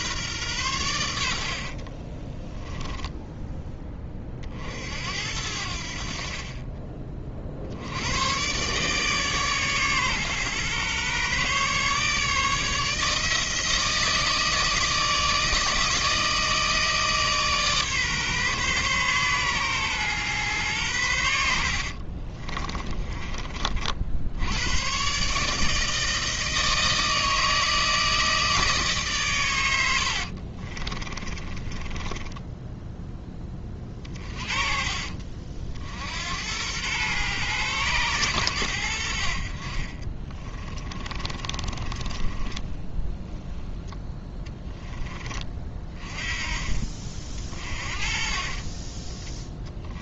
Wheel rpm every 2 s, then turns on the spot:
100, 10, 60, 30, 140, 130, 160, 160, 160, 130, 100, 20, 120, 160, 150, 30, 10, 40, 110, 90, 20, 10, 20, 30, 20.
2-4 22-24 30-32 40-44